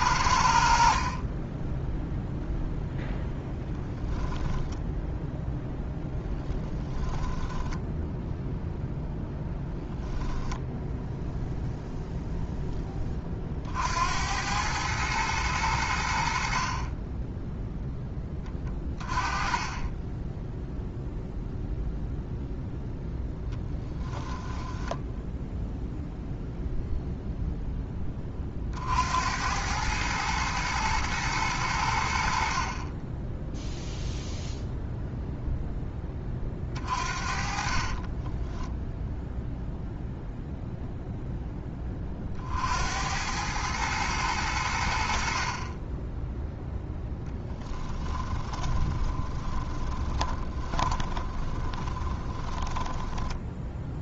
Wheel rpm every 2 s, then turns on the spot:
0, 0, 0, 0, 10, 0, 60, 90, 10, 10, 0, 10, 0, 10, 100, 90, 0, 10, 40, 0, 10, 100, 30, 10, 20, 20, 10.
22-24 36-38 46-54